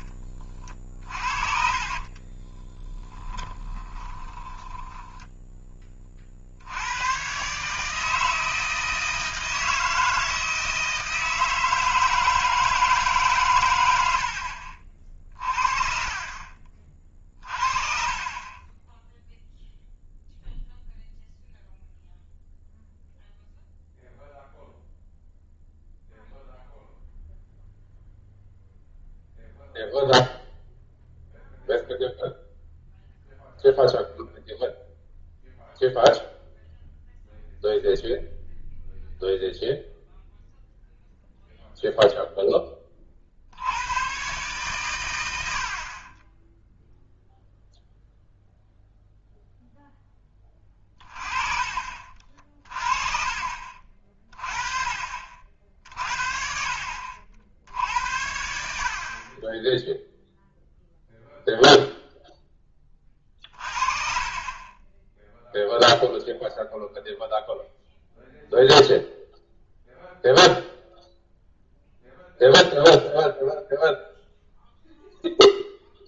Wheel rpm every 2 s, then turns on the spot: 30, 20, 20, 80, 160, 160, 160, 60, 30, 10, 0, 0, 0, 0, 0, 0, 0, 0, 0, 0, 0, 10, 130, 0, 0, 20, 40, 40, 50, 70, 0, 20, 20, 0, 0, 0, 0, 0.
0-6